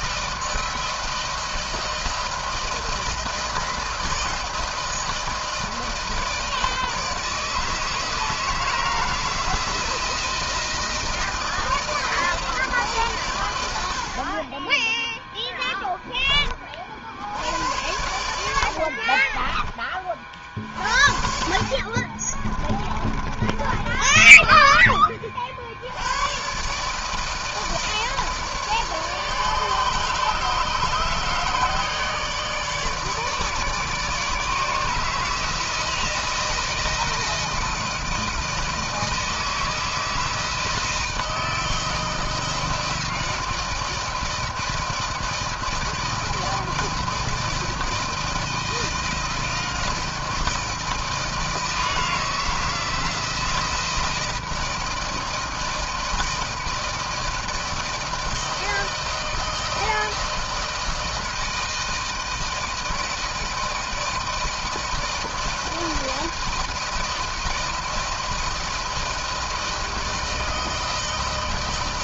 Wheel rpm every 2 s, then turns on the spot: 160, 160, 160, 160, 160, 160, 160, 40, 10, 70, 40, 30, 30, 120, 160, 150, 150, 160, 160, 160, 160, 160, 160, 160, 160, 160, 160, 160, 160, 160, 160, 160, 160, 160, 160, 160.
18-20 22-26